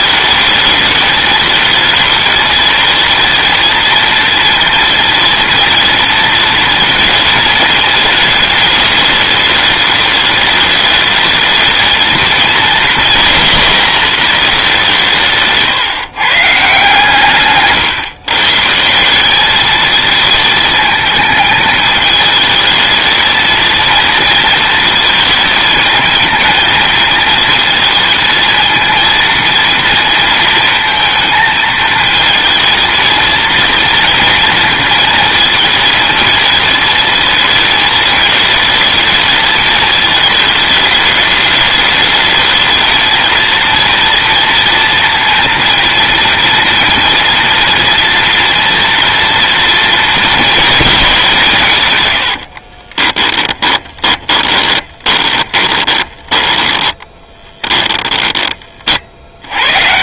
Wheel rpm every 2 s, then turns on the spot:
220, 220, 230, 230, 210, 220, 230, 190, 140, 160, 220, 220, 230, 220, 230, 230, 230, 230, 220, 220, 210, 220, 230, 230, 230, 210, 30, 20, 20, 50.
52-58